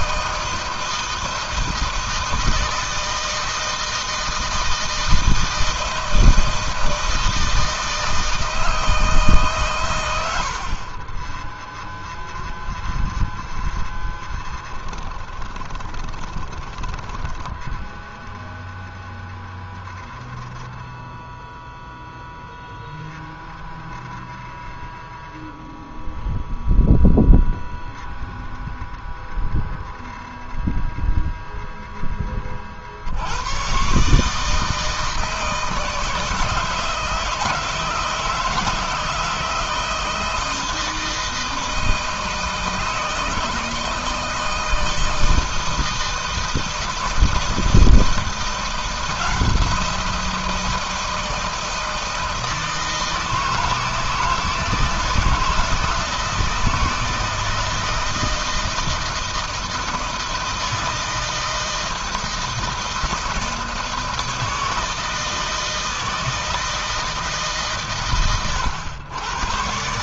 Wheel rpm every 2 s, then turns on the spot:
160, 160, 160, 160, 160, 40, 0, 10, 20, 0, 0, 0, 0, 0, 0, 0, 40, 160, 160, 160, 160, 160, 160, 160, 170, 170, 160, 160, 160, 160, 160, 160, 160, 160, 110.
14-18